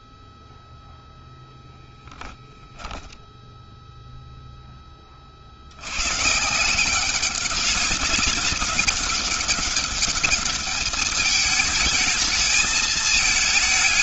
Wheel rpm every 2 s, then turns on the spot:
0, 10, 0, 150, 200, 200, 220.
2-4